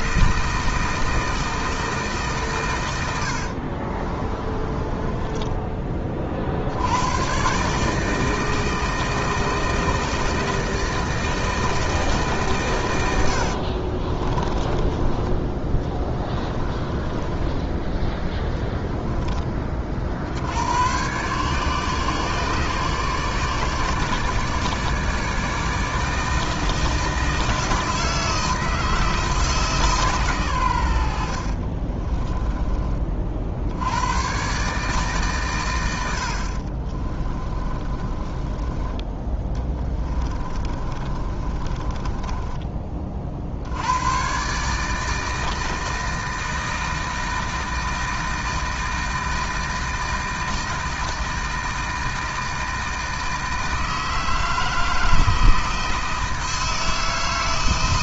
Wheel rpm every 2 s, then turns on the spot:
160, 110, 20, 90, 160, 160, 110, 20, 20, 10, 120, 150, 150, 160, 160, 100, 30, 150, 40, 30, 40, 30, 150, 160, 160, 160, 160, 160, 160.
4-6 14-18 36-38 40-42